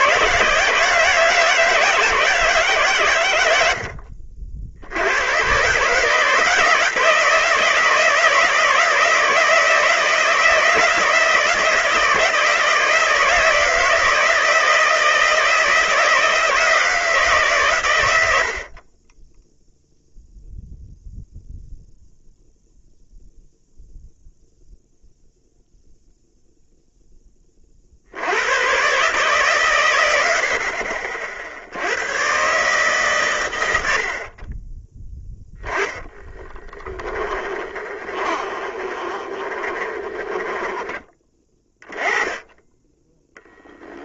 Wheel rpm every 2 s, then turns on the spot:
160, 130, 70, 160, 160, 170, 160, 160, 160, 40, 0, 0, 0, 0, 130, 60, 140, 20, 20, 30, 20, 20.
36-42